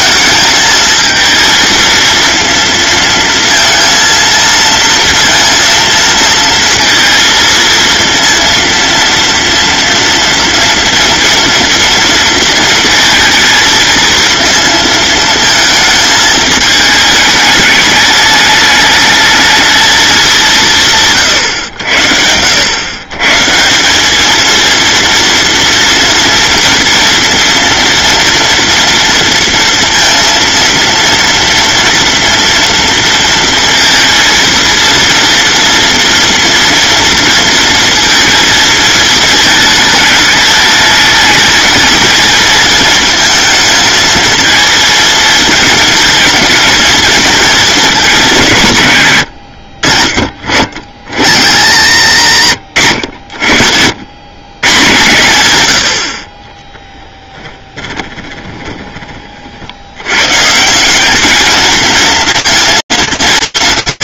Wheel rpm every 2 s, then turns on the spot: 220, 230, 230, 220, 230, 230, 230, 230, 220, 210, 190, 90, 220, 240, 240, 230, 230, 230, 230, 220, 220, 230, 220, 230, 140, 50, 90, 120, 20, 20, 160, 230.
52-54 56-60